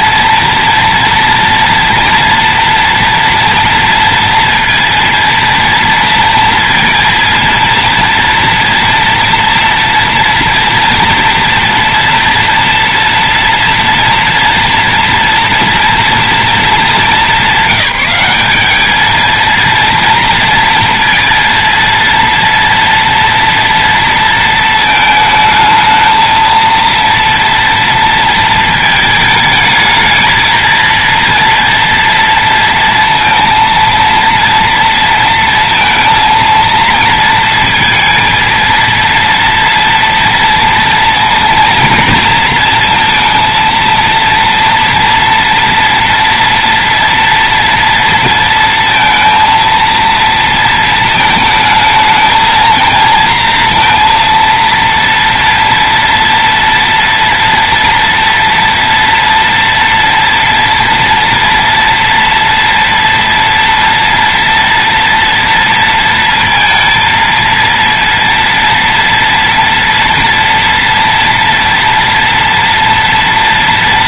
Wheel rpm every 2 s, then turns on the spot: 230, 230, 230, 230, 230, 230, 240, 230, 210, 220, 230, 230, 220, 230, 220, 230, 230, 230, 230, 230, 230, 230, 230, 230, 230, 220, 230, 230, 230, 230, 230, 230, 230, 220, 230, 240, 230.
none